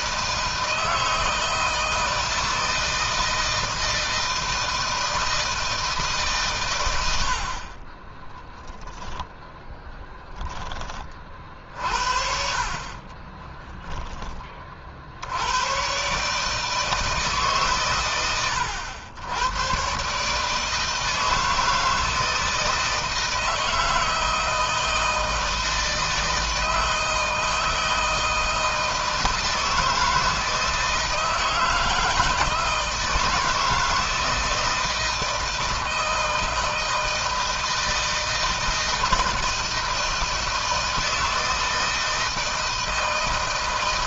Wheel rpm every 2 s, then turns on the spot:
160, 160, 160, 130, 0, 10, 50, 30, 150, 100, 150, 160, 160, 160, 160, 160, 160, 160, 160, 160, 160, 160.
none